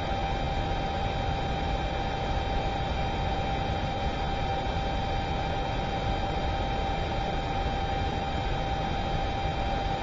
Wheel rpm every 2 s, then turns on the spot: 0, 0, 0, 0, 0.
none